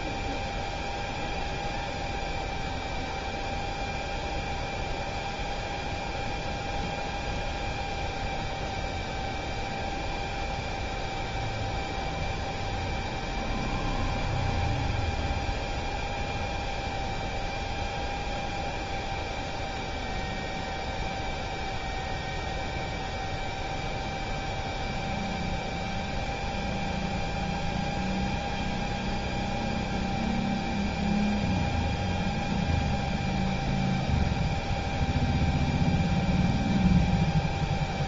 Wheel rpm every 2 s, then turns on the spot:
0, 0, 0, 0, 0, 0, 0, 0, 0, 0, 0, 0, 0, 0, 0, 0, 0, 0, 0.
none